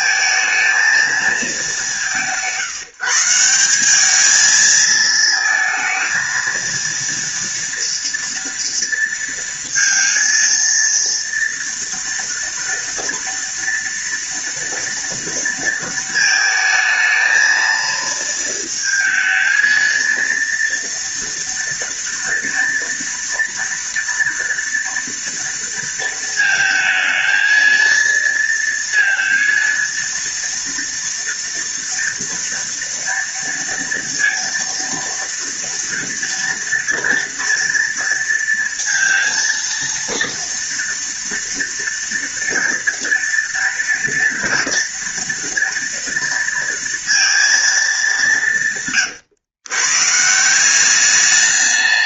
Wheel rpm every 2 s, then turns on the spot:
210, 160, 220, 230, 230, 230, 230, 230, 220, 220, 230, 230, 230, 230, 230, 240, 230, 230, 230, 230, 230, 230, 230, 230, 120, 200.
none